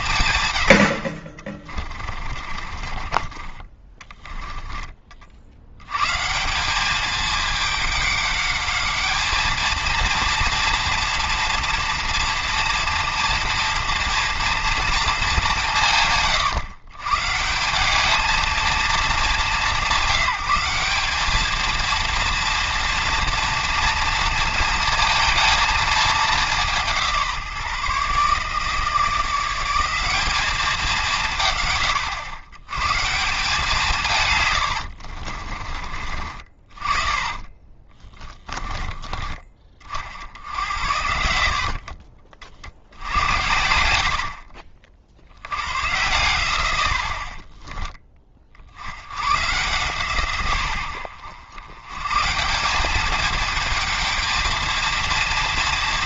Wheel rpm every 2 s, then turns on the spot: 80, 30, 20, 200, 210, 230, 230, 230, 140, 220, 200, 230, 230, 180, 160, 200, 130, 70, 40, 20, 80, 60, 40, 90, 70, 100, 190, 230.
2-4 34-38